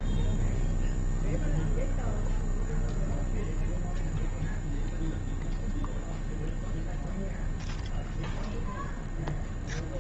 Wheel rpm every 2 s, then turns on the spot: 0, 0, 0, 0, 0.
none